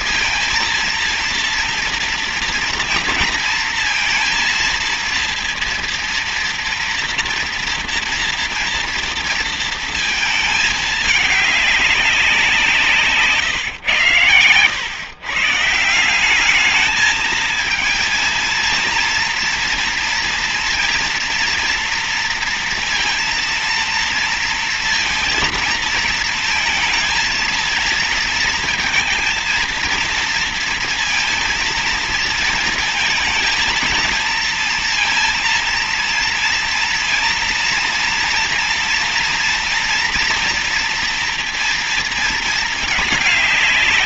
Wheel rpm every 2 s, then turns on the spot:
230, 230, 230, 230, 230, 220, 180, 110, 200, 230, 230, 230, 230, 230, 230, 230, 230, 230, 230, 230, 230, 220.
none